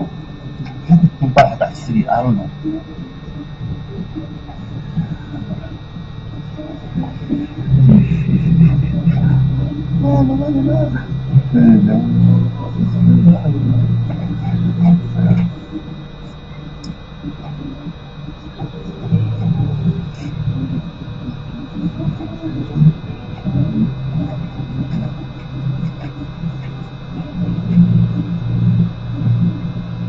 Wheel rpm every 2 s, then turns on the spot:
0, 0, 0, 0, 0, 0, 0, 0, 0, 0, 0, 0, 0, 0, 0.
none